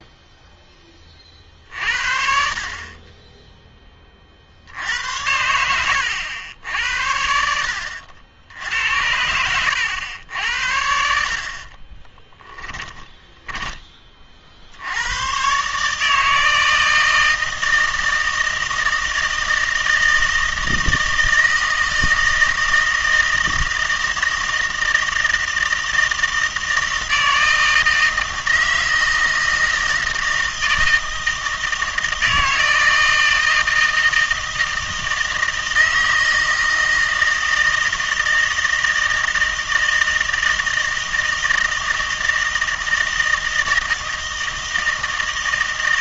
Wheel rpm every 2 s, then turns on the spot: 20, 40, 70, 80, 80, 70, 10, 80, 160, 160, 160, 160, 160, 160, 160, 160, 160, 160, 160, 160, 160, 160, 160.
12-14